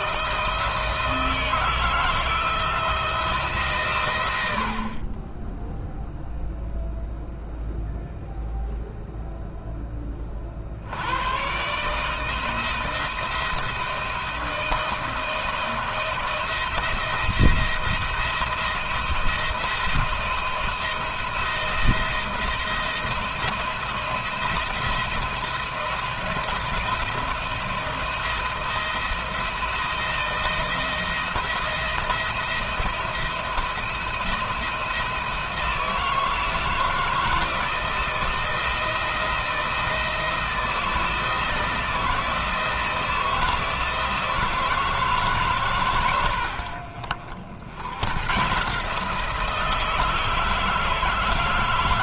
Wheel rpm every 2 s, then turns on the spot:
160, 160, 80, 0, 0, 50, 160, 170, 170, 170, 170, 170, 170, 170, 170, 160, 170, 170, 160, 160, 160, 160, 160, 70, 130, 160.
none